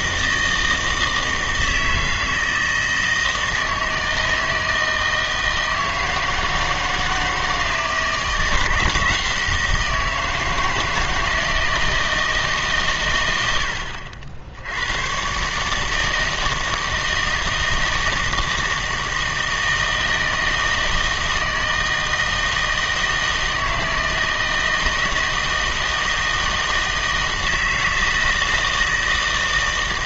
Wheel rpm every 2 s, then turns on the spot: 160, 160, 160, 160, 170, 160, 140, 90, 160, 160, 160, 160, 160, 160, 160.
none